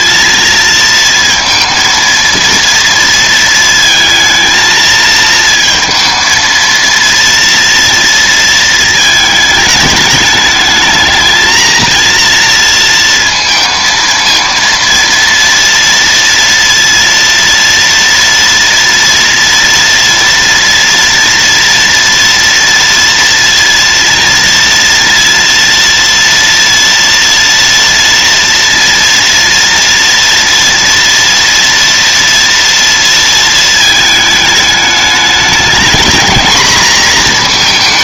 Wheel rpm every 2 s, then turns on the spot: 230, 230, 220, 230, 220, 220, 230, 230, 230, 230, 230, 230, 230, 230, 230, 230, 230, 210, 230.
none